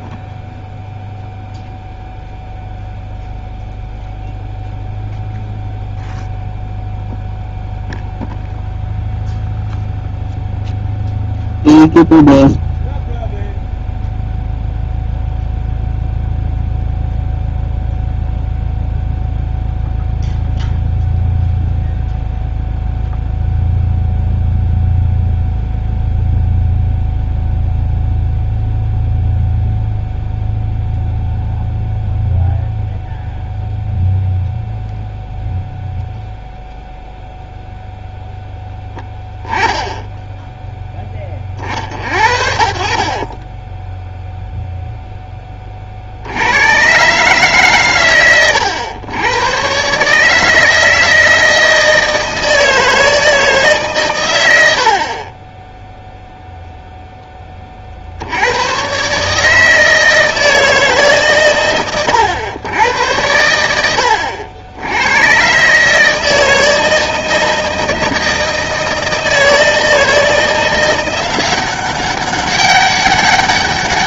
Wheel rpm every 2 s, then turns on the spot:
0, 0, 0, 0, 0, 0, 0, 0, 0, 0, 0, 0, 0, 0, 0, 0, 0, 0, 0, 10, 0, 50, 0, 90, 110, 160, 160, 100, 0, 100, 160, 110, 80, 160, 160, 170, 200.
none